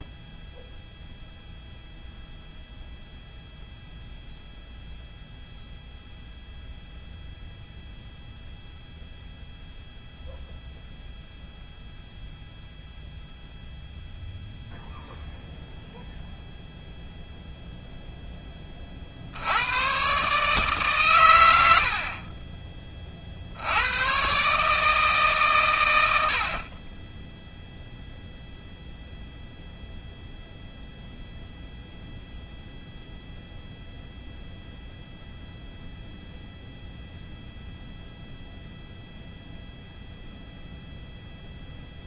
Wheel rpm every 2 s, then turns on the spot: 0, 0, 0, 0, 0, 0, 0, 0, 0, 50, 130, 30, 150, 20, 0, 0, 0, 0, 0, 0, 0.
none